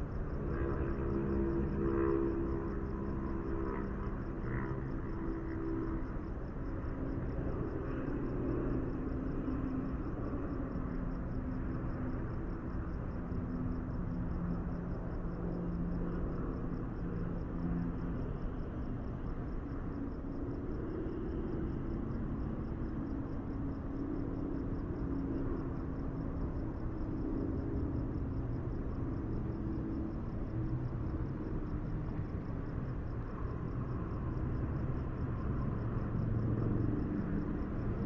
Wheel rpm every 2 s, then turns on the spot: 0, 0, 0, 0, 0, 0, 0, 0, 0, 0, 0, 0, 0, 0, 0, 0, 0, 0, 0.
none